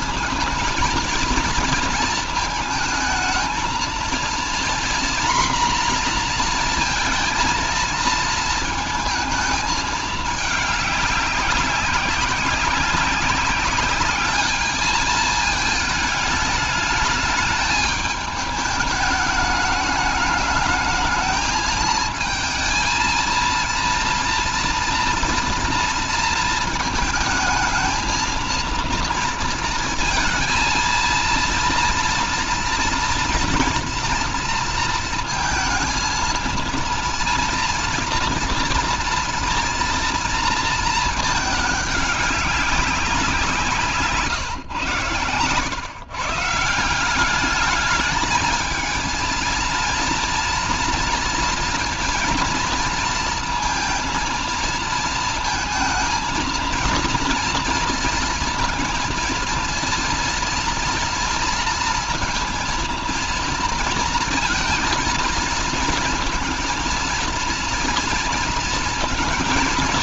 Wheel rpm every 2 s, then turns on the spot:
230, 230, 240, 230, 230, 210, 190, 210, 210, 210, 220, 230, 240, 220, 230, 230, 230, 230, 230, 230, 230, 190, 130, 160, 220, 230, 230, 230, 230, 230, 230, 230, 230, 220, 230.
none